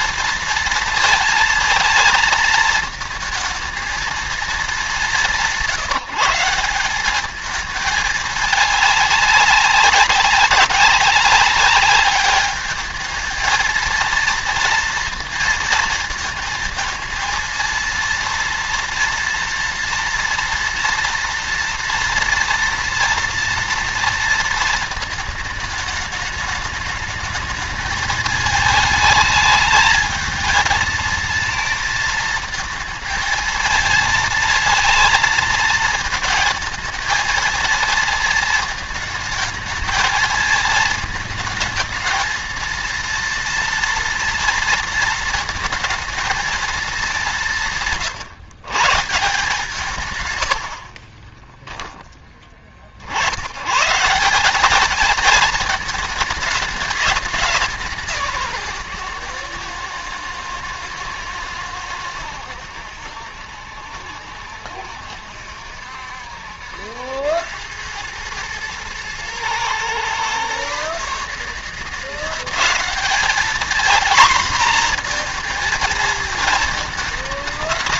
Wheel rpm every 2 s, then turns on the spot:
230, 220, 220, 190, 210, 190, 210, 230, 220, 230, 230, 230, 230, 210, 220, 220, 220, 220, 230, 220, 220, 220, 230, 220, 120, 80, 40, 200, 210, 150, 120, 80, 70, 70, 110, 130, 190, 240, 230.
50-52